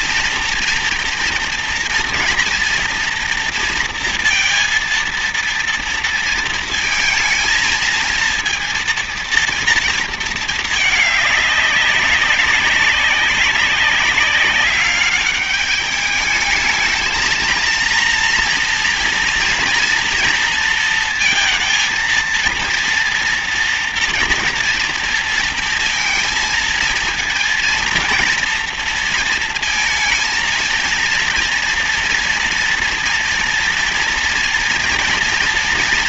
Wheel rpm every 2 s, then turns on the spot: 230, 230, 230, 230, 230, 220, 200, 210, 220, 230, 230, 230, 230, 230, 230, 230, 230, 230.
none